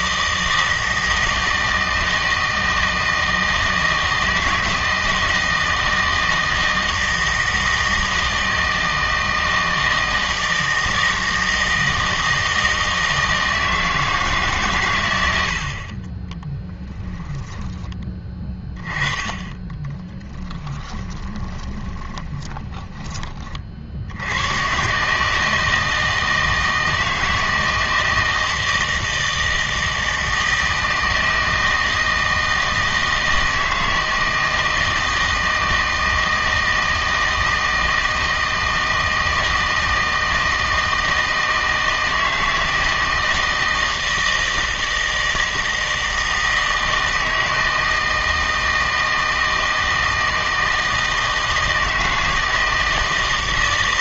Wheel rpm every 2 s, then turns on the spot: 160, 160, 160, 160, 160, 160, 160, 120, 10, 20, 10, 10, 120, 160, 160, 160, 160, 160, 160, 160, 160, 160, 160, 160, 160, 160, 160.
20-24